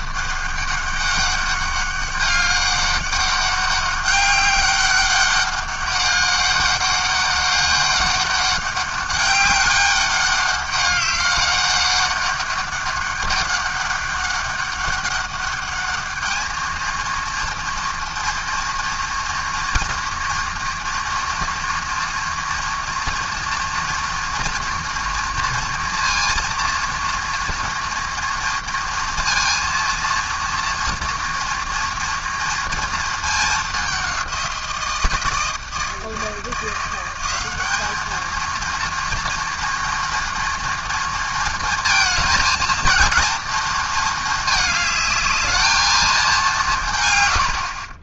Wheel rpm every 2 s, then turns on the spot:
200, 200, 200, 200, 200, 200, 200, 200, 220, 230, 230, 230, 240, 230, 230, 230, 230, 170, 170, 230, 230, 230, 220, 160.
none